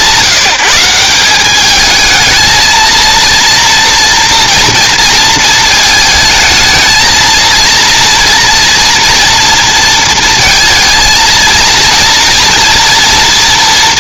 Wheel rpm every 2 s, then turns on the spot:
180, 230, 230, 220, 230, 230, 240.
none